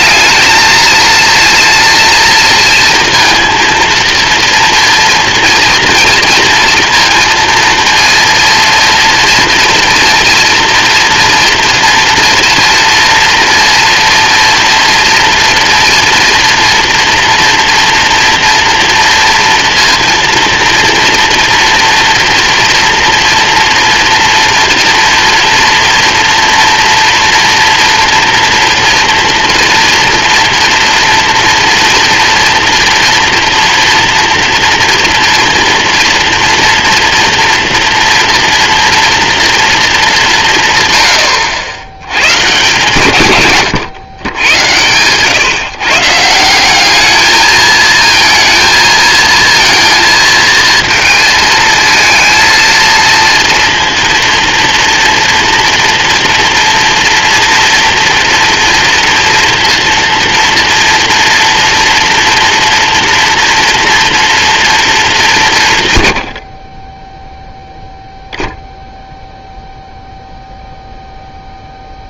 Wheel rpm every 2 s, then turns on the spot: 230, 230, 230, 230, 230, 230, 230, 230, 230, 230, 230, 230, 240, 240, 240, 230, 230, 230, 230, 230, 120, 130, 120, 210, 230, 230, 230, 230, 230, 230, 230, 230, 210, 20, 0, 0.
none